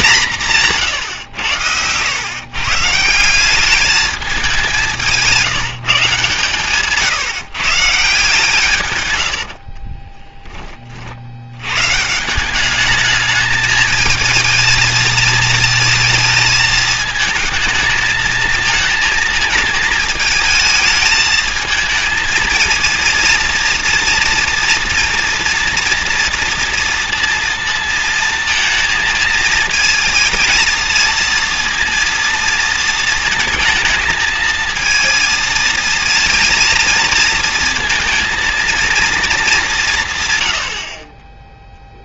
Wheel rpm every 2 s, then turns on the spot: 160, 130, 190, 150, 130, 30, 200, 220, 220, 220, 220, 230, 230, 230, 230, 230, 230, 230, 230, 230, 60.
none